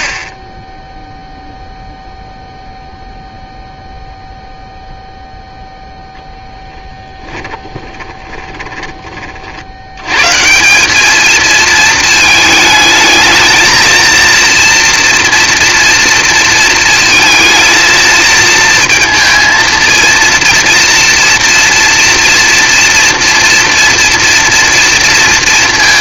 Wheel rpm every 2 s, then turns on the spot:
20, 0, 0, 20, 30, 200, 220, 240, 220, 230, 230, 240, 230.
6-10